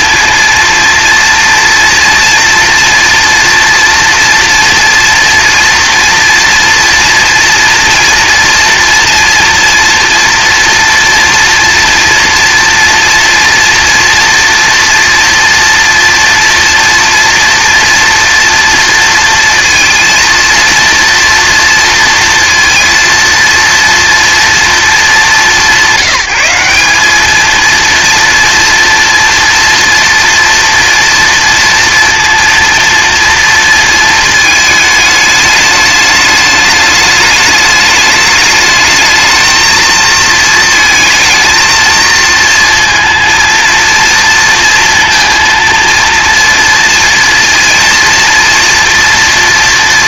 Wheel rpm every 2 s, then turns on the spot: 230, 230, 230, 230, 230, 230, 230, 240, 230, 230, 230, 230, 210, 200, 230, 240, 230, 210, 210, 220, 220, 230, 230, 230, 230.
none